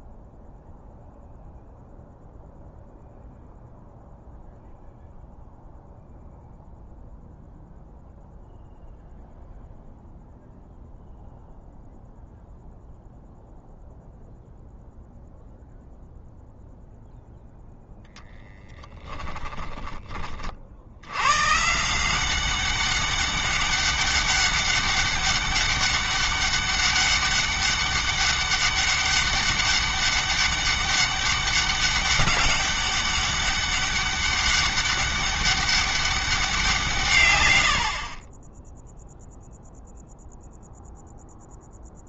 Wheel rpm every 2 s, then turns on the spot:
0, 0, 0, 0, 0, 0, 0, 0, 0, 10, 70, 200, 200, 200, 200, 200, 200, 200, 160, 10, 0.
18-20